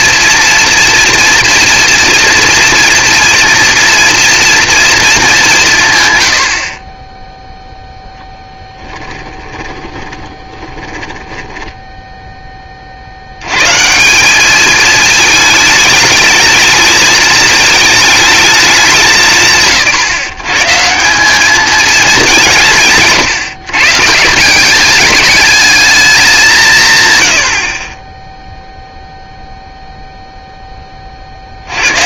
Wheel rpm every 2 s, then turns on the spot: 240, 230, 230, 40, 10, 20, 20, 200, 210, 210, 150, 200, 170, 190, 0, 0.
8-12